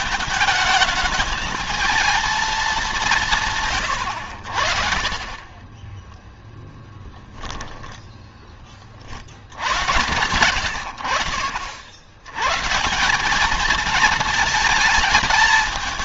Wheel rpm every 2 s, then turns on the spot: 220, 200, 60, 10, 30, 90, 150, 220.
none